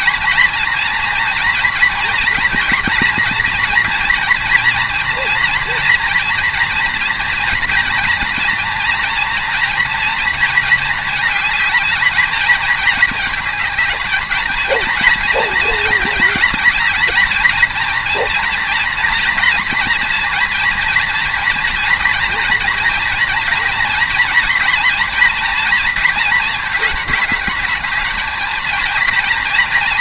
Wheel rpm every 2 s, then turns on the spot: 230, 240, 230, 230, 230, 230, 220, 220, 220, 230, 230, 230, 230, 220, 230.
none